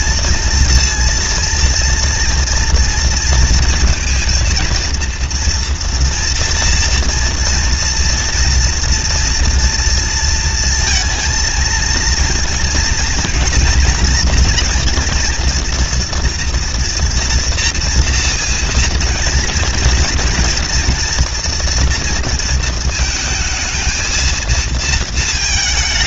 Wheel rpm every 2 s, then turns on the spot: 230, 230, 230, 230, 230, 230, 230, 230, 240, 230, 230, 230, 220.
none